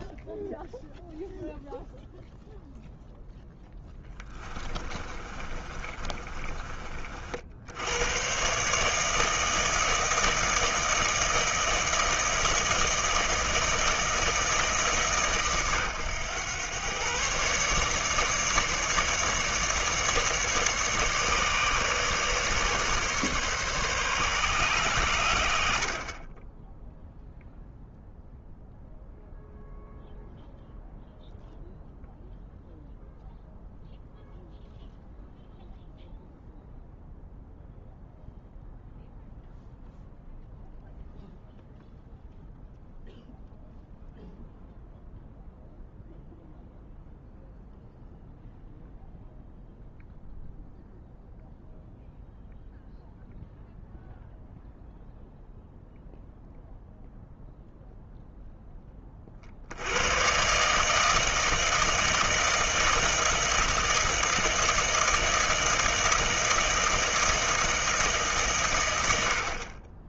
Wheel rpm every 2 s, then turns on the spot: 0, 0, 20, 30, 120, 160, 160, 150, 110, 150, 150, 150, 110, 0, 0, 0, 0, 0, 0, 0, 0, 0, 0, 0, 0, 0, 0, 0, 0, 30, 150, 160, 160, 160, 100.
4-8